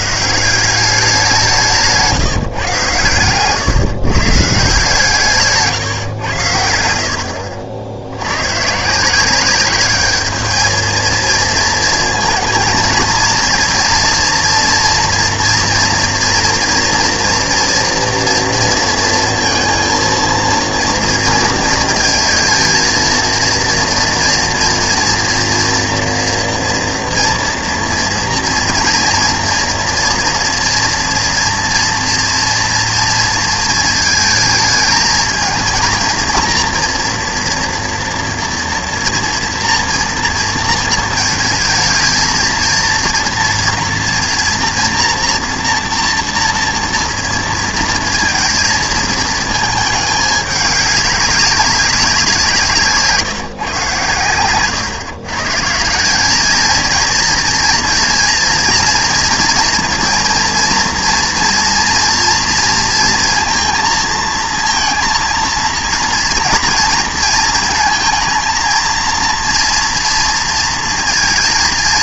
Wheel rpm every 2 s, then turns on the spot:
170, 140, 150, 90, 140, 220, 230, 240, 230, 230, 230, 230, 230, 240, 230, 230, 230, 220, 230, 230, 230, 230, 230, 230, 230, 200, 180, 130, 210, 230, 230, 230, 230, 230, 230, 230.
none